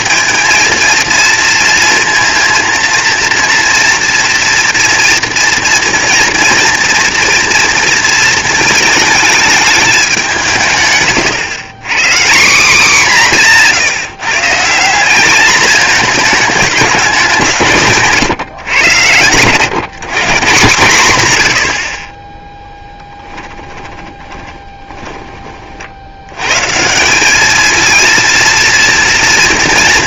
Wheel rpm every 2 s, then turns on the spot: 230, 230, 230, 230, 220, 150, 190, 170, 210, 130, 160, 10, 20, 130, 230.
24-26